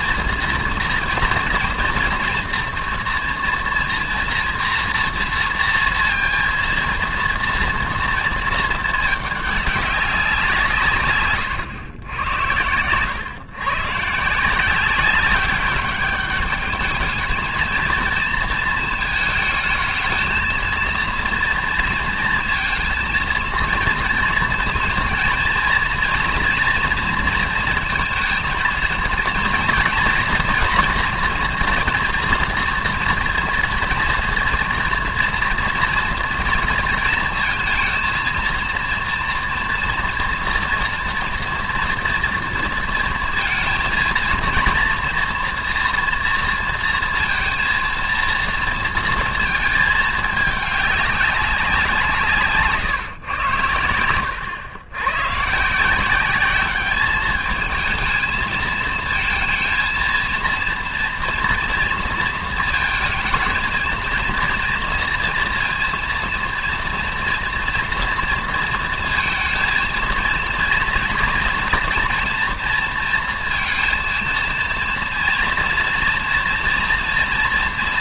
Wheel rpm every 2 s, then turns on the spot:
230, 230, 240, 230, 230, 190, 110, 160, 210, 230, 220, 230, 230, 230, 230, 230, 230, 230, 230, 230, 230, 230, 230, 230, 230, 210, 160, 100, 190, 220, 230, 230, 230, 230, 230, 230, 230, 230, 230.
none